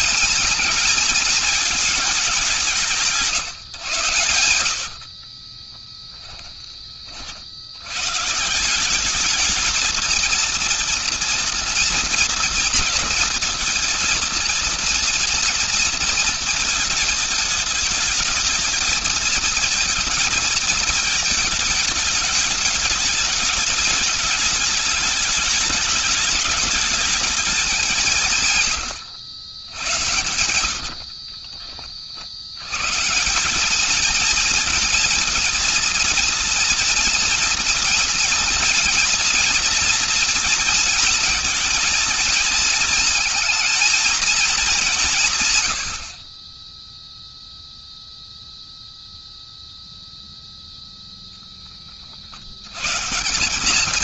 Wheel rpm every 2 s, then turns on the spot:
220, 190, 90, 20, 160, 230, 240, 230, 230, 220, 220, 210, 210, 210, 160, 80, 70, 220, 230, 230, 230, 230, 220, 40, 0, 0, 50.
4-6 30-32